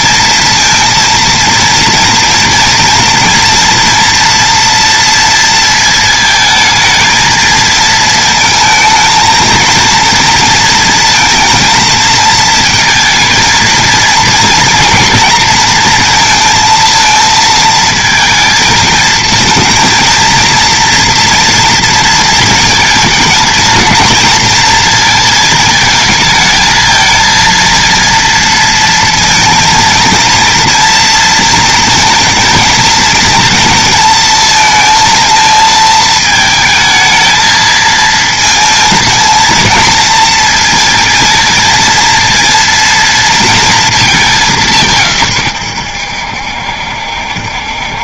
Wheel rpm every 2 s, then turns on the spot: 230, 230, 230, 230, 230, 230, 220, 230, 220, 220, 230, 230, 230, 220, 230, 230, 230, 230, 220, 220, 230, 230, 150, 70.
none